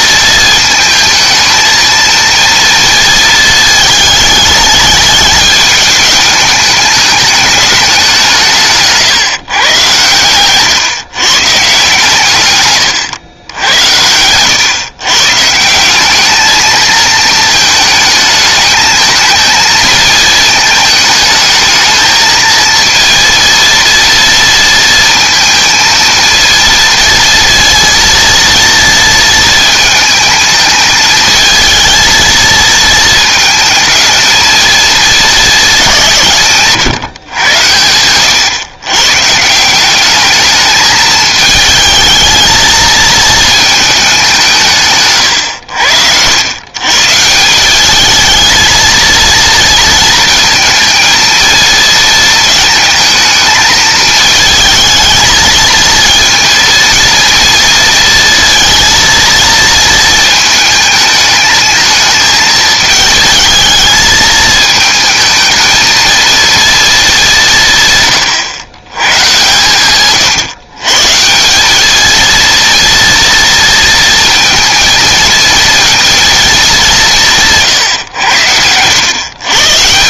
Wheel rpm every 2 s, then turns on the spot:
220, 230, 210, 210, 160, 130, 120, 120, 210, 220, 220, 230, 230, 230, 230, 220, 220, 220, 150, 130, 220, 220, 150, 120, 230, 230, 220, 220, 230, 230, 220, 220, 220, 230, 110, 130, 230, 230, 210, 90.
10-12